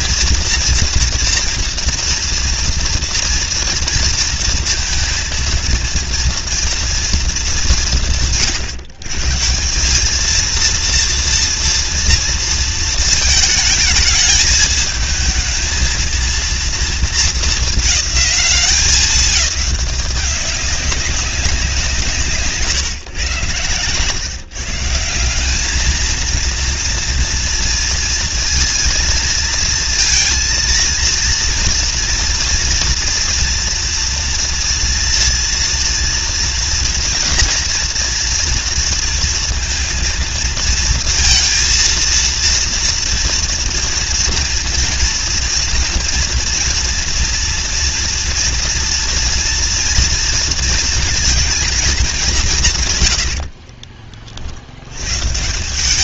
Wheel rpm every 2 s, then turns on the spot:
230, 230, 230, 230, 130, 230, 220, 220, 230, 210, 200, 140, 150, 230, 230, 230, 230, 230, 240, 230, 230, 230, 230, 230, 230, 230, 160, 80.
none